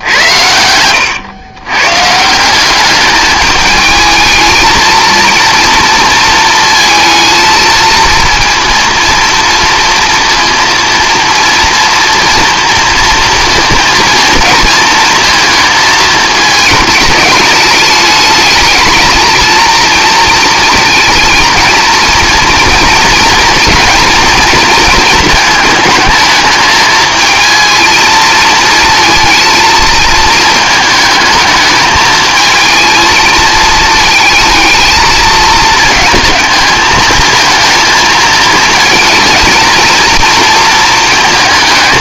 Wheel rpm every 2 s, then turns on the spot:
100, 190, 220, 230, 230, 230, 230, 230, 210, 220, 220, 230, 230, 220, 230, 220, 220, 220, 220, 220, 220.
0-2